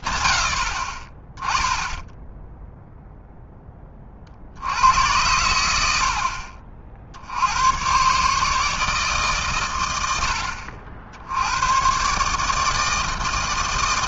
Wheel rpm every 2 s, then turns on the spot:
10, 0, 70, 40, 150, 70, 150.
none